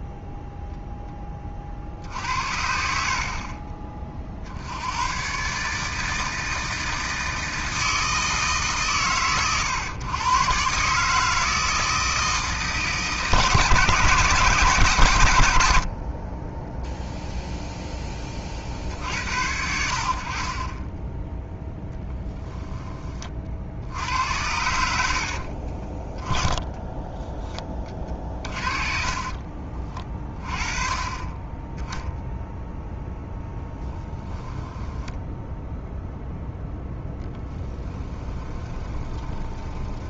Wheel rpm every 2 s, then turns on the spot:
0, 60, 80, 160, 120, 130, 160, 150, 10, 60, 30, 10, 80, 10, 40, 30, 0, 10, 0, 20.
26-30 34-36 38-40